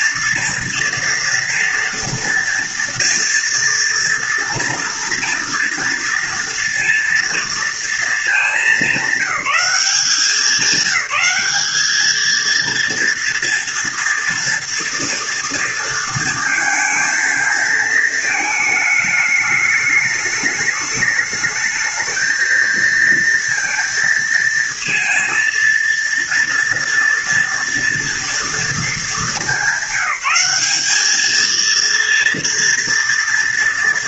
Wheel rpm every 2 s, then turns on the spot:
230, 230, 230, 230, 200, 190, 230, 230, 230, 210, 210, 230, 230, 240, 220, 210, 230.
none